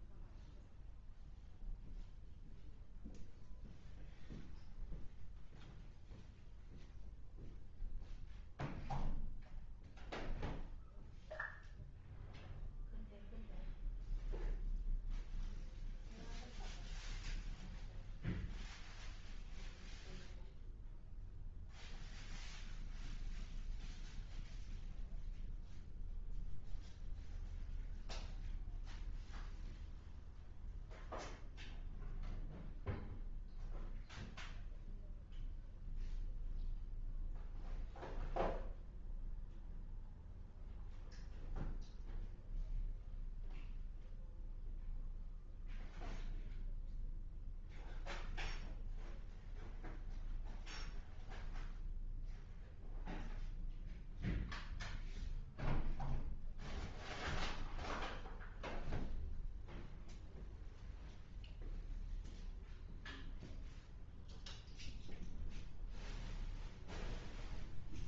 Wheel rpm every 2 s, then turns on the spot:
0, 0, 0, 0, 0, 0, 0, 0, 0, 0, 0, 0, 0, 0, 0, 0, 0, 0, 0, 0, 0, 0, 0, 0, 0, 0, 0, 0, 0, 0, 0, 0, 0, 0.
none